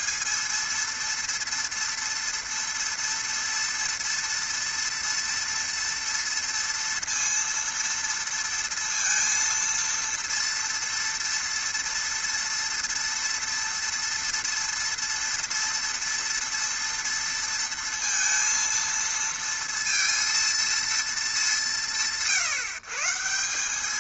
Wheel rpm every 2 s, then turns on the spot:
230, 230, 230, 230, 230, 230, 230, 230, 230, 230, 230, 140.
none